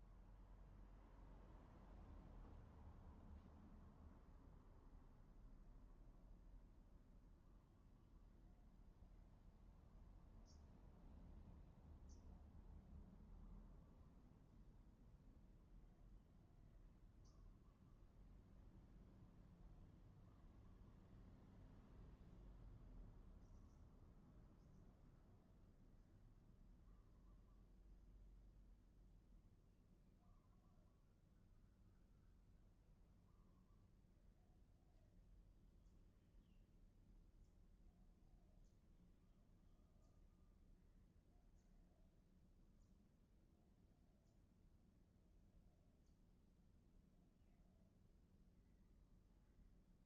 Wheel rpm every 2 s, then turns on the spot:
0, 0, 0, 0, 0, 0, 0, 0, 0, 0, 0, 0, 0, 0, 0, 0, 0, 0, 0, 0, 0, 0, 0, 0, 0.
none